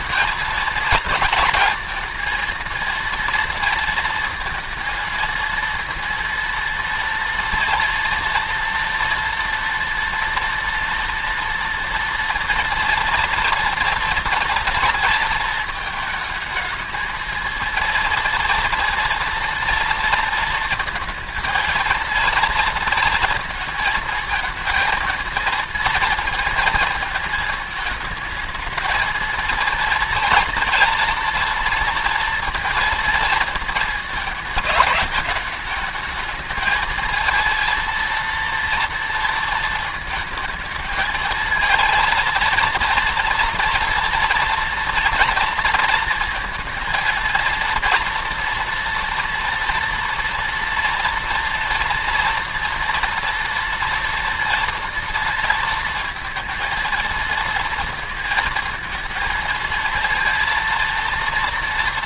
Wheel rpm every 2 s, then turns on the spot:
230, 230, 230, 230, 230, 240, 240, 230, 220, 230, 220, 230, 220, 230, 220, 230, 230, 220, 220, 230, 220, 230, 230, 230, 230, 240, 230, 230, 230, 230, 230.
none